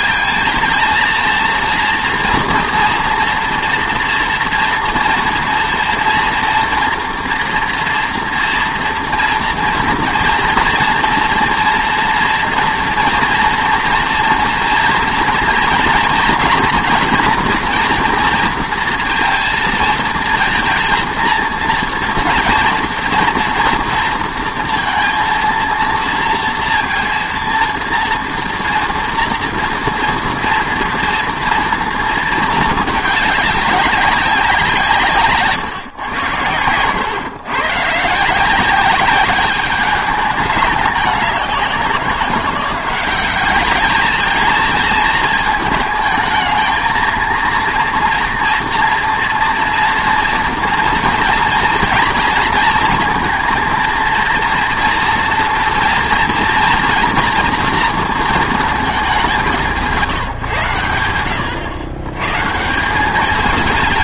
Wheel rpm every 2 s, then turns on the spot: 220, 230, 240, 230, 230, 230, 240, 240, 230, 230, 230, 230, 230, 230, 230, 230, 220, 180, 100, 180, 200, 180, 220, 220, 240, 230, 230, 230, 230, 220, 110, 160.
none